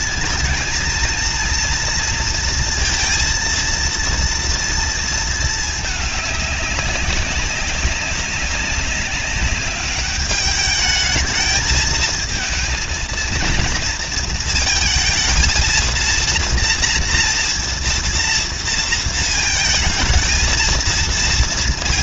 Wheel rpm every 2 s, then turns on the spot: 230, 230, 230, 210, 200, 210, 220, 230, 230, 230, 230.
none